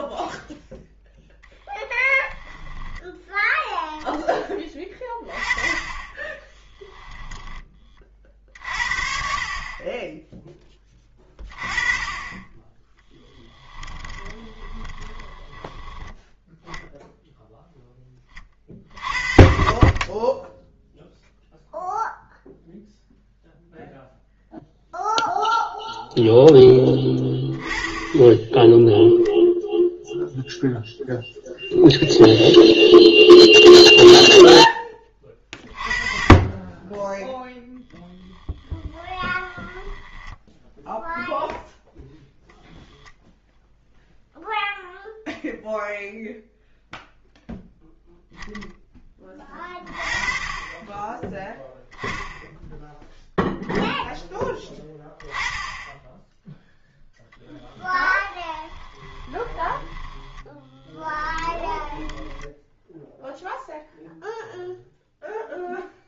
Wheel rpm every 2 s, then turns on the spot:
0, 10, 20, 10, 50, 10, 10, 20, 0, 40, 0, 0, 0, 10, 10, 0, 0, 10, 20, 20, 0, 0, 0, 0, 10, 20, 10, 10, 0, 20, 10, 10, 0.
6-8 14-16 38-40 58-64